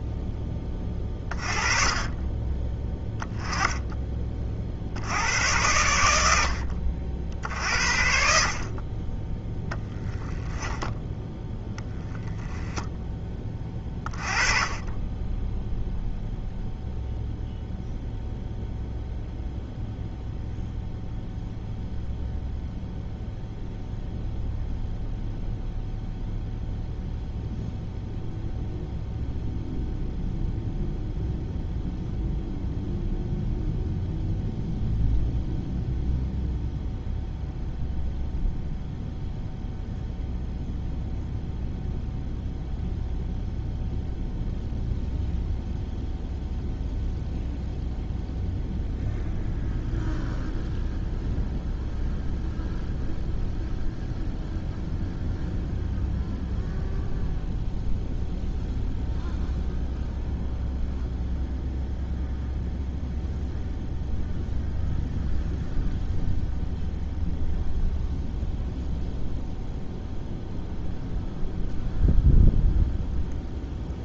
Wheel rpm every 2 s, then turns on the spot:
20, 10, 70, 70, 20, 0, 10, 20, 0, 0, 0, 0, 0, 0, 0, 0, 0, 0, 0, 0, 0, 0, 0, 0, 0, 0, 0, 0, 0, 0, 0, 0, 0, 0, 0, 0, 0.
none